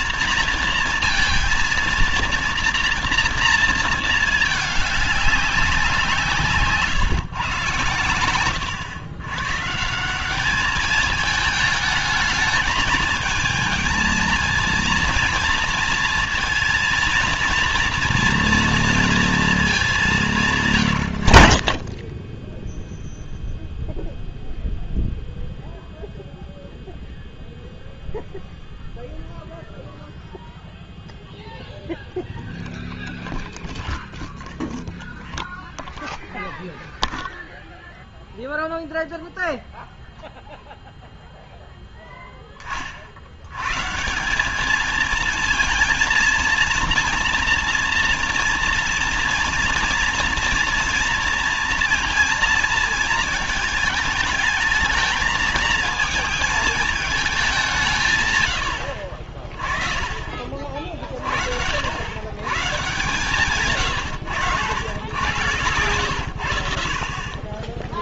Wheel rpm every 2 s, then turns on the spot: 230, 240, 210, 160, 110, 190, 220, 230, 230, 230, 170, 10, 0, 0, 0, 0, 0, 0, 0, 0, 0, 10, 190, 230, 230, 230, 220, 210, 220, 110, 30, 120, 120, 90.
none